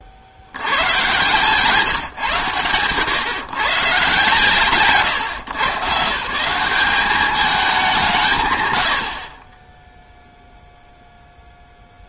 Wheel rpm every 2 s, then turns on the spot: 100, 120, 140, 180, 120, 0.
none